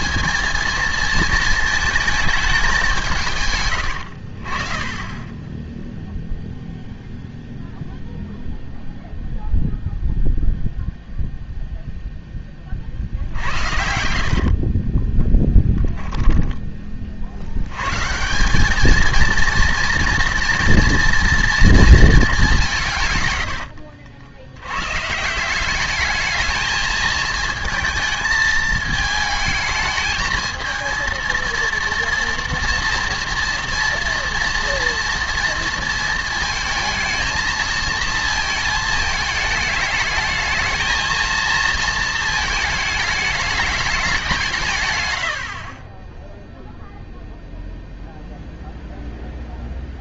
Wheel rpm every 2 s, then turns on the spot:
230, 200, 30, 0, 0, 0, 30, 30, 30, 200, 240, 170, 100, 220, 220, 220, 230, 230, 220, 220, 220, 220, 140, 0, 0.
14-16